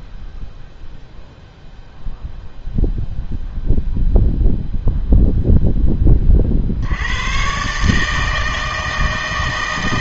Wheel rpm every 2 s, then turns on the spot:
0, 0, 0, 70, 160.
none